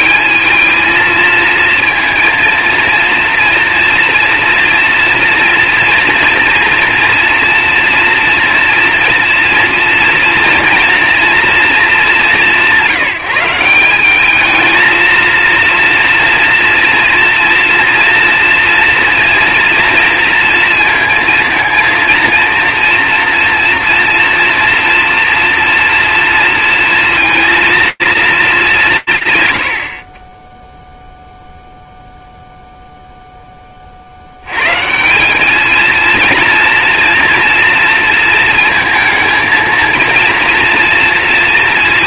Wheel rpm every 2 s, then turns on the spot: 220, 230, 230, 230, 230, 230, 180, 220, 230, 230, 230, 230, 230, 230, 200, 10, 0, 140, 230, 220, 230.
none